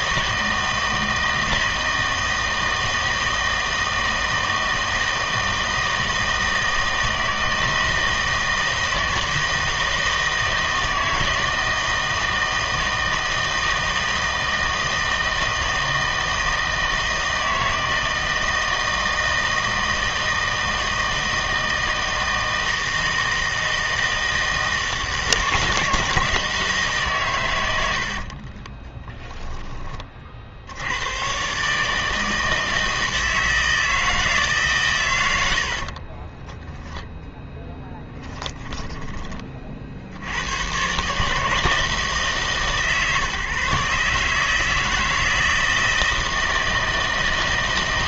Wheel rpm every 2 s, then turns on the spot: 160, 160, 160, 160, 160, 160, 160, 160, 160, 160, 160, 160, 160, 150, 40, 80, 160, 140, 0, 10, 120, 150, 160, 160.
28-30 38-40